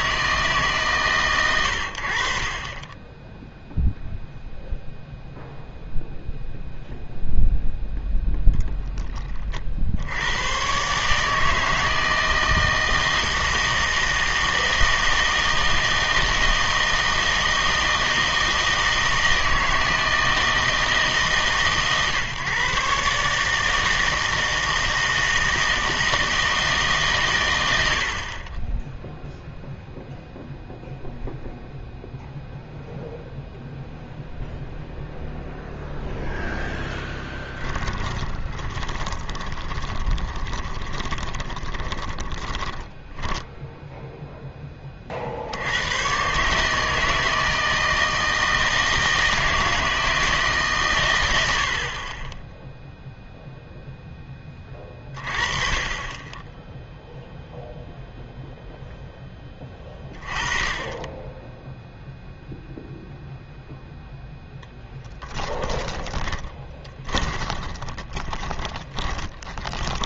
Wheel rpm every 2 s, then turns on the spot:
140, 20, 0, 0, 0, 120, 160, 160, 160, 160, 160, 140, 160, 160, 10, 0, 0, 0, 0, 20, 20, 10, 20, 150, 160, 150, 10, 20, 10, 0, 20, 0, 0, 30, 20.
38-44 66-70